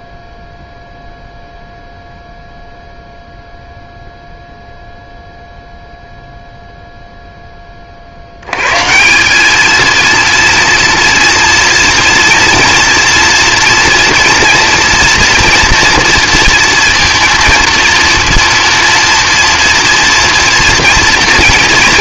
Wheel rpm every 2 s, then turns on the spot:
0, 0, 0, 0, 120, 230, 230, 230, 230, 230, 230.
none